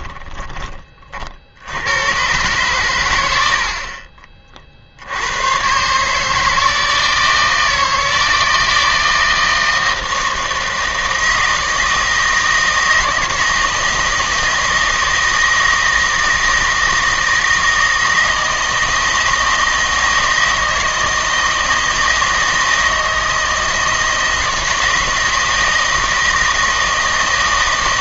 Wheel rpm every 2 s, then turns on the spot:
30, 120, 50, 160, 160, 160, 160, 160, 160, 160, 160, 160, 160, 160.
none